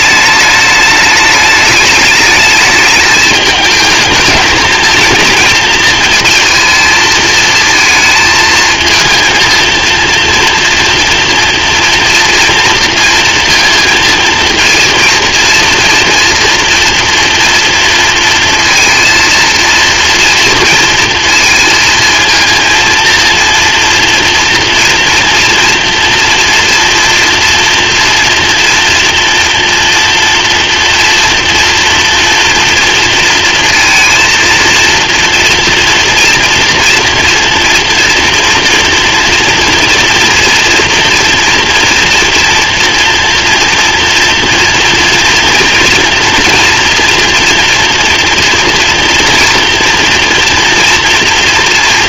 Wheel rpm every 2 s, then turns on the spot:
210, 210, 220, 220, 220, 230, 230, 230, 230, 230, 230, 230, 240, 230, 230, 230, 230, 230, 240, 230, 230, 240, 240, 230, 230, 230.
none